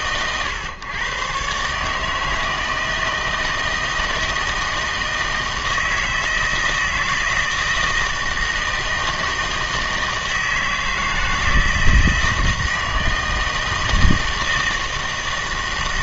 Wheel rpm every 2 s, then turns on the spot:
120, 160, 160, 160, 160, 160, 160, 160.
none